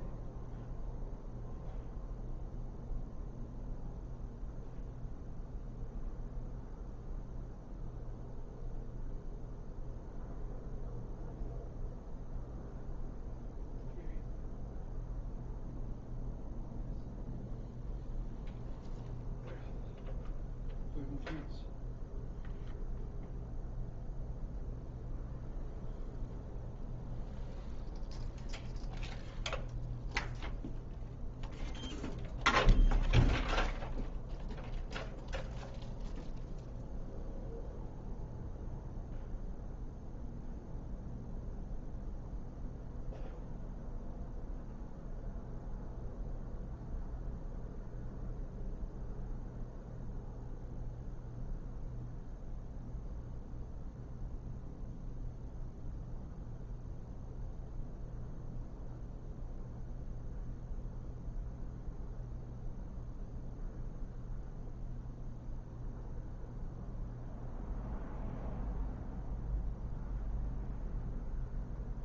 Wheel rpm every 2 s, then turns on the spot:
0, 0, 0, 0, 0, 0, 0, 0, 0, 0, 0, 0, 0, 0, 0, 0, 0, 0, 0, 0, 0, 0, 0, 0, 0, 0, 0, 0, 0, 0, 0, 0, 0, 0, 0, 0.
none